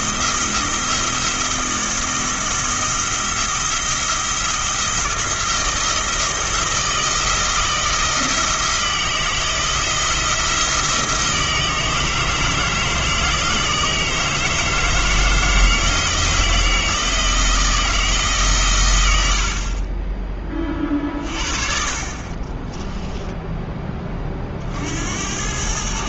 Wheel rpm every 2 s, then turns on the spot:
170, 170, 170, 170, 160, 170, 160, 160, 160, 130, 30, 20, 50.
22-24